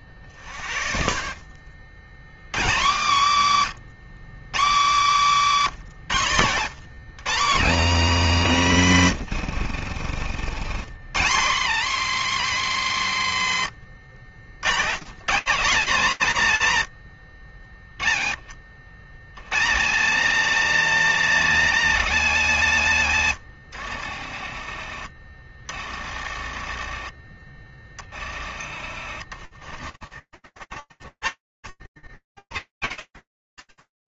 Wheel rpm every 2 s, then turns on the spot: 60, 70, 100, 100, 80, 100, 110, 120, 50, 40, 120, 70, 30, 30, 30, 40, 70.
22-24 28-30